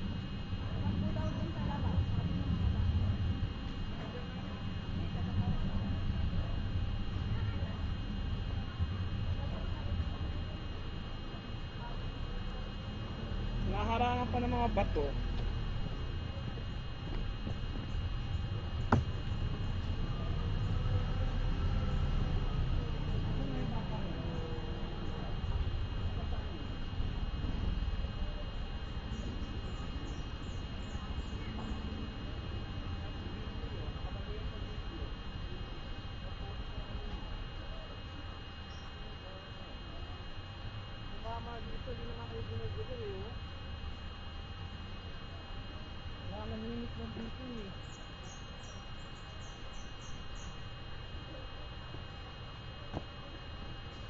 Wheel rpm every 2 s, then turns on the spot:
0, 0, 0, 0, 0, 0, 0, 0, 0, 0, 0, 0, 0, 0, 0, 0, 0, 0, 0, 0, 0, 0, 0, 0, 0, 0, 0.
none